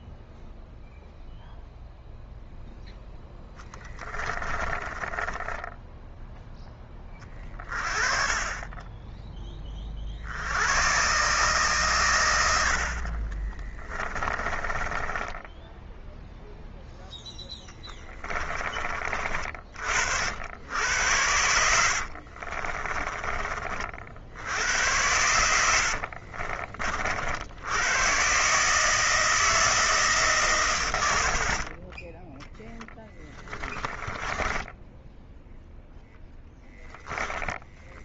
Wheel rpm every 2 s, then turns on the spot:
0, 0, 20, 10, 30, 90, 90, 30, 0, 30, 90, 40, 70, 40, 140, 110, 10, 10, 10.
4-6 12-16 18-20 22-24 34-36